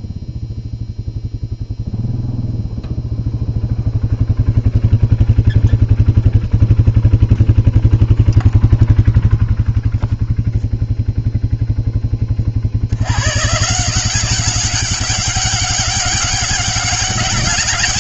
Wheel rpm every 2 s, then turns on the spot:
0, 0, 0, 0, 0, 0, 90, 190, 200.
none